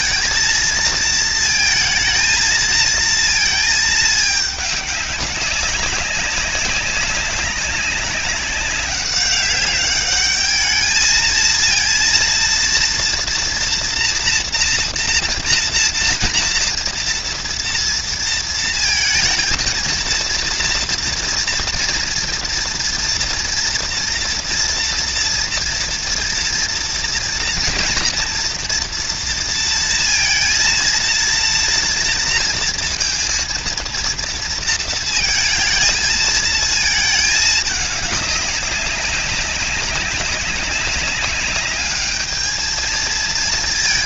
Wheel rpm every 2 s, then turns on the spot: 230, 230, 210, 200, 200, 210, 230, 240, 230, 230, 230, 230, 230, 230, 240, 230, 230, 230, 220, 200, 190, 220.
none